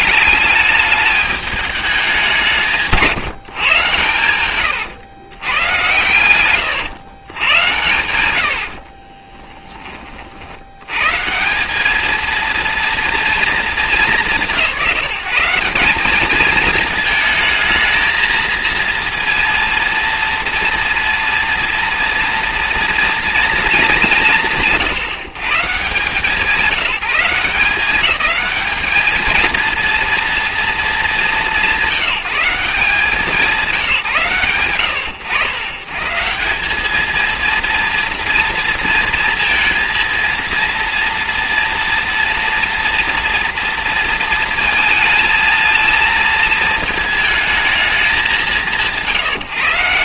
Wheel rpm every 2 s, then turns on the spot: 210, 160, 110, 120, 30, 130, 230, 170, 220, 230, 230, 230, 150, 180, 220, 220, 180, 110, 220, 230, 240, 240, 220, 220, 150.
8-10